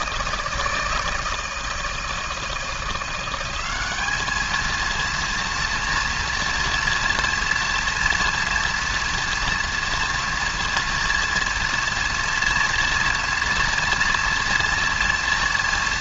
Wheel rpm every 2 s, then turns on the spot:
160, 170, 230, 230, 230, 230, 230, 230.
none